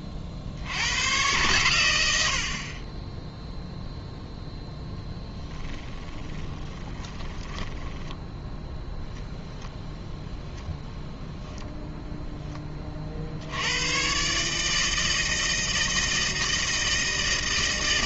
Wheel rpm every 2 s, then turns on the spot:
70, 60, 0, 20, 10, 0, 20, 150, 160.
6-8